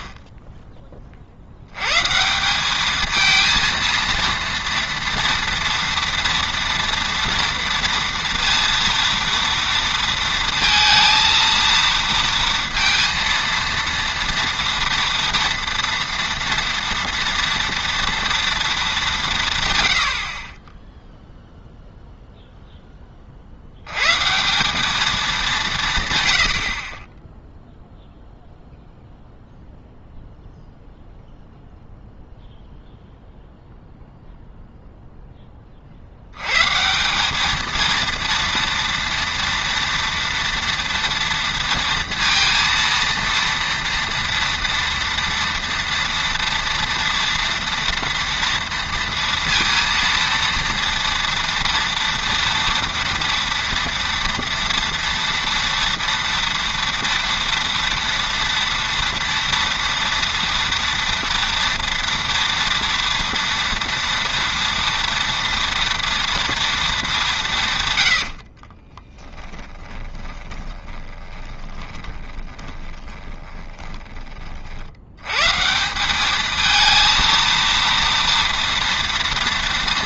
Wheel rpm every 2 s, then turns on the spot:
10, 190, 230, 240, 230, 230, 230, 230, 230, 230, 30, 0, 180, 70, 0, 0, 0, 0, 140, 230, 230, 230, 230, 230, 230, 230, 230, 230, 230, 230, 230, 240, 230, 230, 50, 20, 10, 50, 220, 230.
68-74